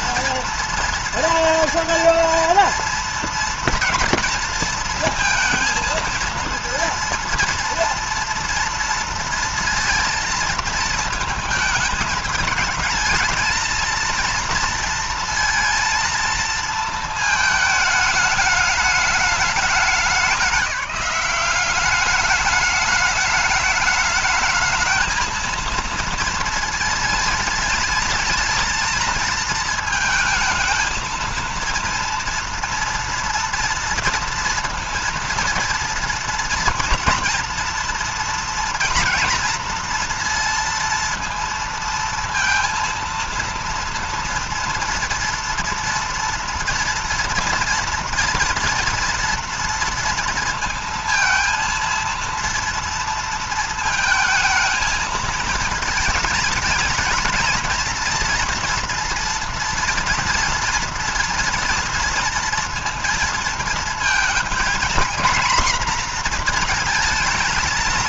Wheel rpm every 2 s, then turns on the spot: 230, 230, 230, 230, 230, 230, 220, 230, 230, 210, 200, 210, 220, 230, 230, 230, 230, 230, 230, 230, 230, 230, 230, 230, 230, 230, 230, 220, 220, 230, 230, 230, 230, 230.
none